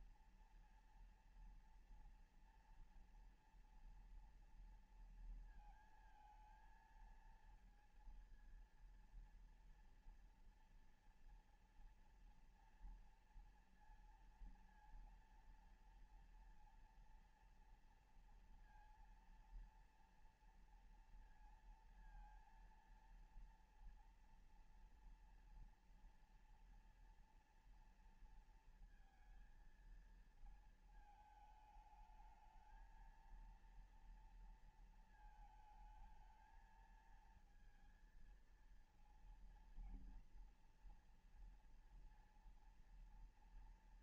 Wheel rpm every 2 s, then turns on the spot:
230, 240, 230, 230, 230, 230, 230, 230, 230, 230, 230, 230, 230, 230, 230, 220, 220, 230, 220, 230, 230, 230.
none